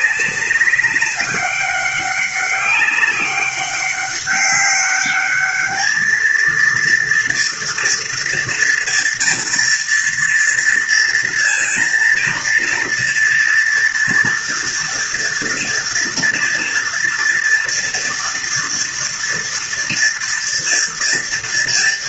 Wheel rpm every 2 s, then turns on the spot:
200, 200, 200, 230, 240, 230, 230, 230, 240, 230, 230.
none